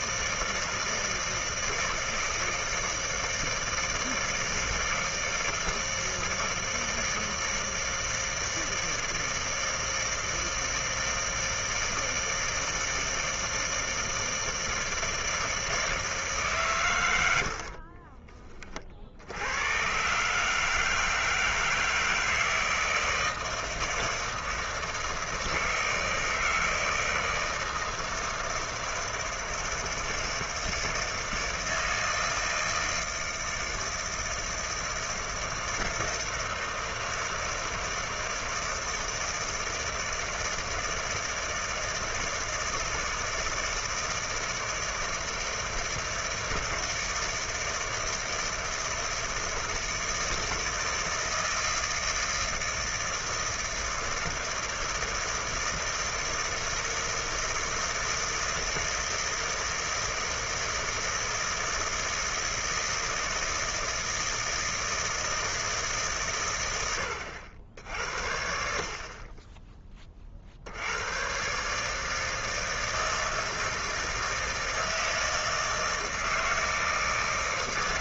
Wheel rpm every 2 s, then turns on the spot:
160, 160, 160, 160, 160, 160, 160, 160, 140, 20, 150, 160, 160, 160, 160, 160, 160, 160, 160, 160, 160, 160, 160, 160, 160, 160, 160, 160, 160, 160, 160, 160, 160, 100, 60, 70, 160, 160, 160.
none